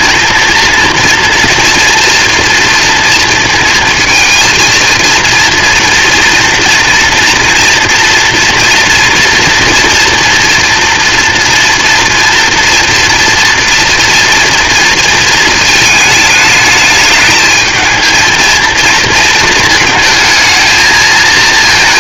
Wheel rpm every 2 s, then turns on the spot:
230, 230, 230, 230, 240, 230, 230, 230, 210, 230, 220.
none